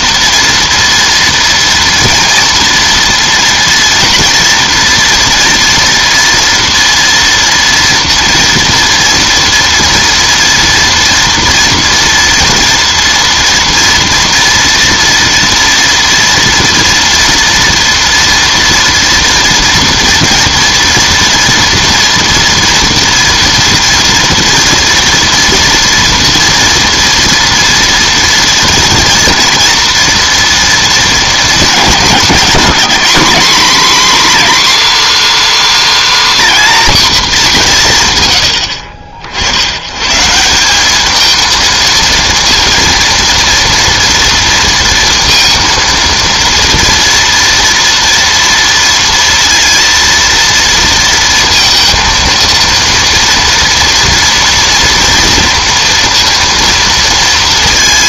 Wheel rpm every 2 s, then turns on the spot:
230, 230, 230, 230, 230, 230, 230, 230, 230, 230, 230, 230, 240, 230, 230, 230, 200, 280, 260, 70, 200, 230, 230, 230, 230, 230, 230, 230, 230.
none